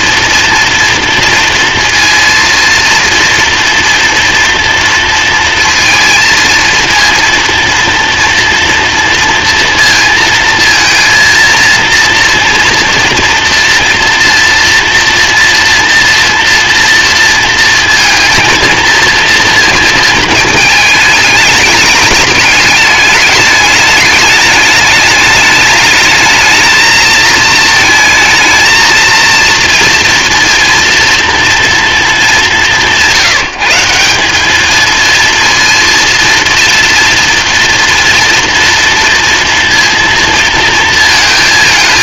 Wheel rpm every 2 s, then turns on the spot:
240, 230, 230, 230, 230, 230, 230, 230, 230, 230, 230, 210, 210, 220, 220, 230, 230, 180, 230, 240, 230.
none